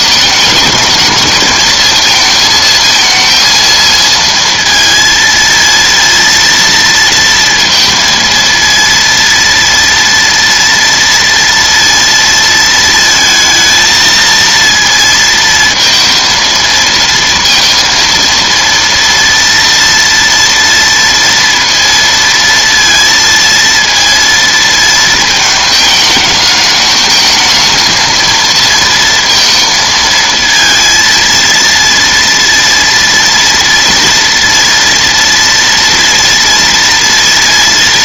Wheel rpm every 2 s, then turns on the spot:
220, 220, 230, 230, 230, 230, 230, 230, 230, 230, 230, 230, 230, 210, 230, 230, 230, 230, 230.
none